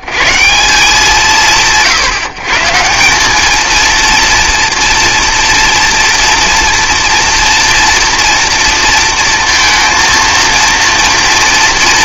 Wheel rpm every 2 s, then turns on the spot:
90, 150, 230, 240, 230, 230.
none